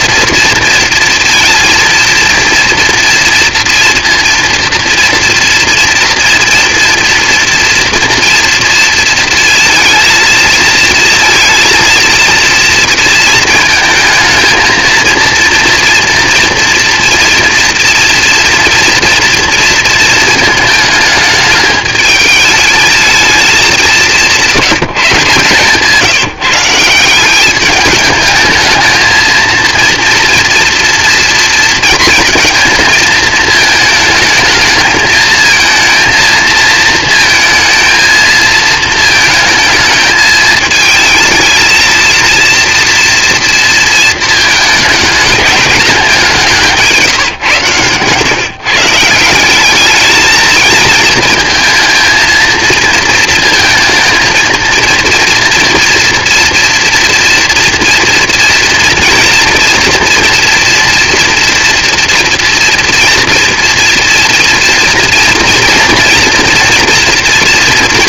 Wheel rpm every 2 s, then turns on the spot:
230, 230, 230, 230, 230, 230, 230, 230, 230, 230, 220, 220, 180, 180, 220, 230, 230, 220, 230, 220, 220, 230, 220, 170, 150, 220, 220, 230, 240, 240, 240, 230, 240, 230.
none